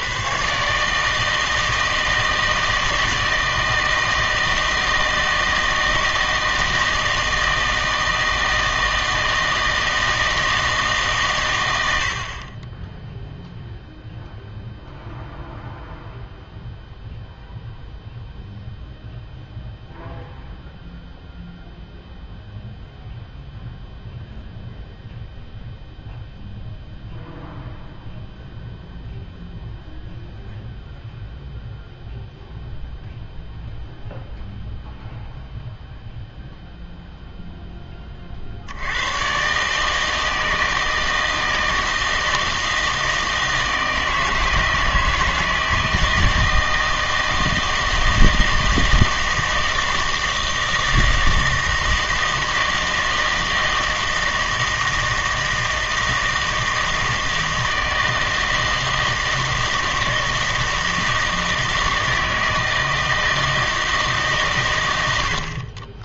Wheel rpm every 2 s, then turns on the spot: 140, 160, 160, 160, 160, 160, 30, 0, 0, 0, 0, 0, 0, 0, 0, 0, 0, 0, 0, 60, 160, 160, 160, 160, 160, 160, 160, 160, 160, 160, 160, 160, 120.
none